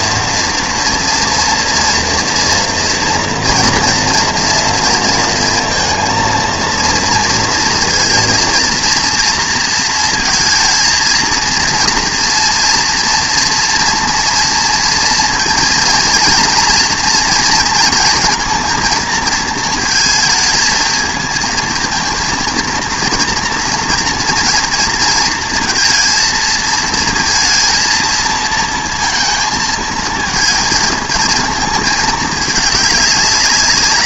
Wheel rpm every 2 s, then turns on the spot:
230, 230, 230, 230, 230, 230, 230, 230, 230, 230, 220, 230, 230, 230, 230, 220, 210.
none